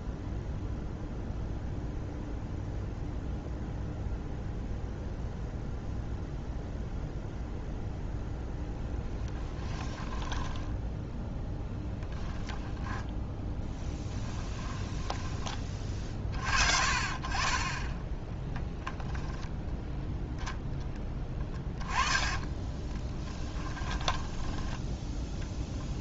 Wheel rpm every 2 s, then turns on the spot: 0, 0, 0, 0, 0, 10, 10, 10, 40, 0, 10, 20, 10.
10-12 14-16 22-26